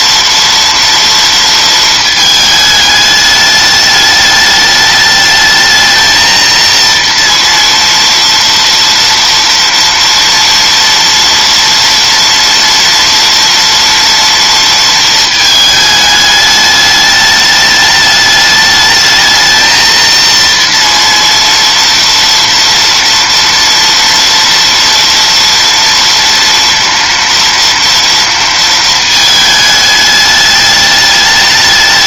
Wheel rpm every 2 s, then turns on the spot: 230, 220, 210, 230, 230, 230, 230, 230, 210, 210, 230, 230, 230, 230, 230, 210.
none